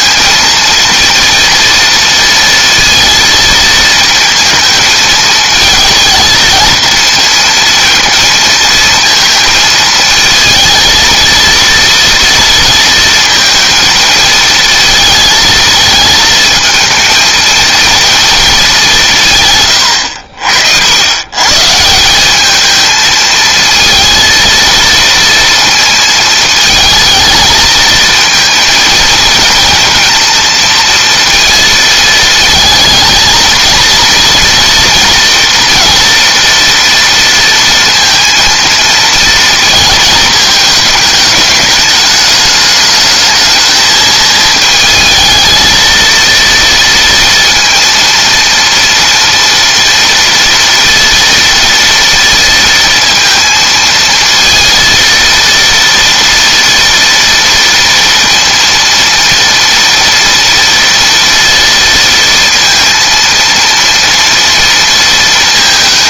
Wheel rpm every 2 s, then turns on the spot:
230, 230, 220, 220, 230, 220, 230, 230, 220, 200, 90, 220, 230, 220, 230, 230, 220, 230, 230, 230, 210, 210, 220, 230, 230, 230, 230, 230, 230, 230, 230, 230, 230.
none